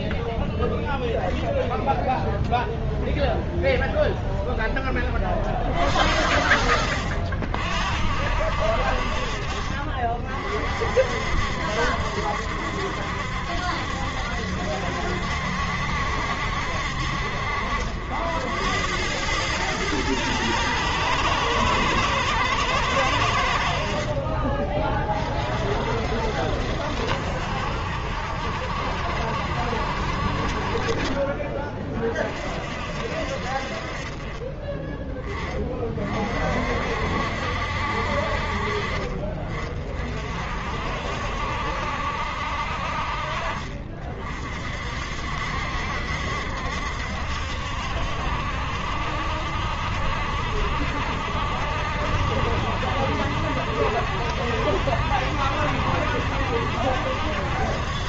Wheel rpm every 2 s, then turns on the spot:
0, 0, 20, 70, 50, 60, 70, 70, 60, 90, 120, 100, 40, 70, 60, 40, 50, 20, 50, 40, 50, 60, 50, 70, 70, 70, 70, 70, 70.
none